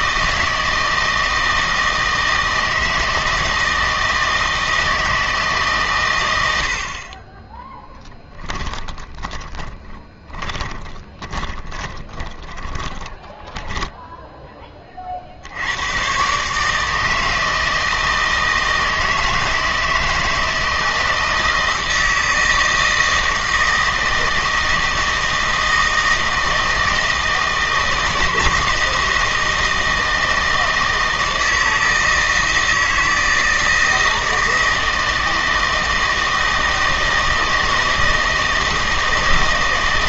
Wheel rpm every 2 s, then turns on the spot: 160, 160, 160, 60, 10, 20, 10, 20, 150, 160, 160, 160, 160, 160, 160, 160, 160, 160, 160, 160.
8-14